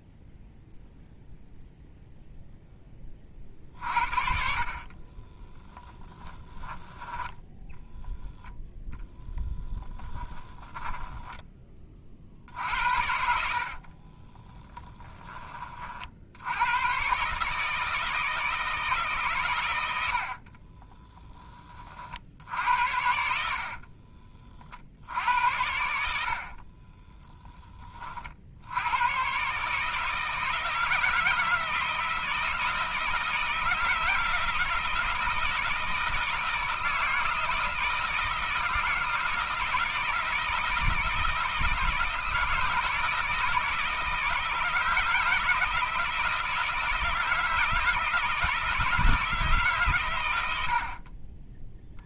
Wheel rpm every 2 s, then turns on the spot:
0, 10, 40, 10, 0, 20, 70, 10, 110, 160, 30, 70, 60, 30, 90, 160, 160, 160, 160, 160, 160, 160, 160, 160, 160, 70.
4-6 10-12 20-22 26-28